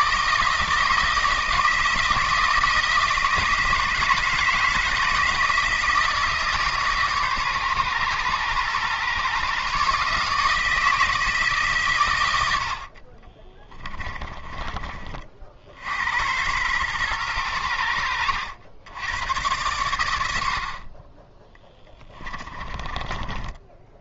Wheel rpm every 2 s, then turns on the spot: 160, 160, 160, 150, 120, 160, 90, 30, 110, 100, 50, 20.
22-24